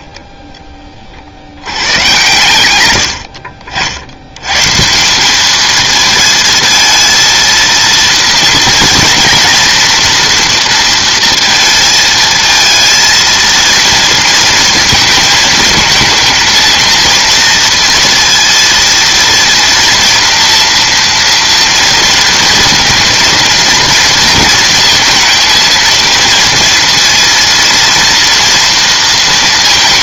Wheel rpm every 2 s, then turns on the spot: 40, 90, 170, 220, 230, 230, 220, 220, 230, 230, 230, 230, 230, 230, 230.
none